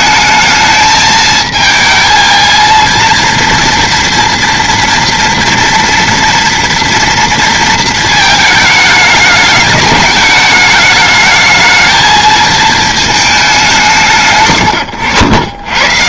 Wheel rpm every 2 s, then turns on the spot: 220, 230, 230, 230, 220, 210, 220, 100.
none